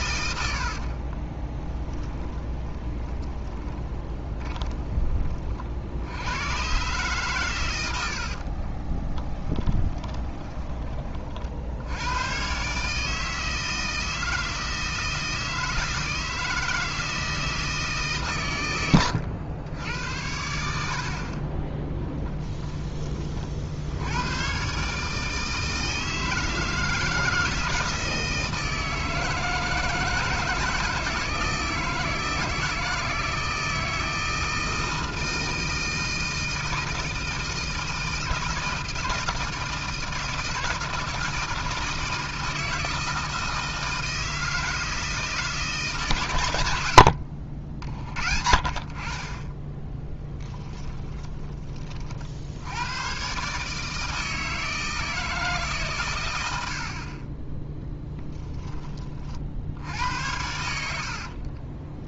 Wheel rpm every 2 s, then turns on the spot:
60, 20, 20, 120, 40, 20, 130, 160, 160, 120, 70, 20, 130, 160, 160, 170, 160, 160, 160, 160, 160, 160, 160, 90, 40, 20, 90, 160, 80, 20, 80.
2-4 8-12 18-20 50-52 56-58 60-62